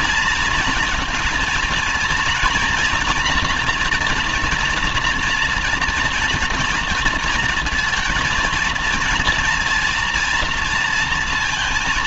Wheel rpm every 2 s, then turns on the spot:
240, 230, 240, 230, 230, 230.
none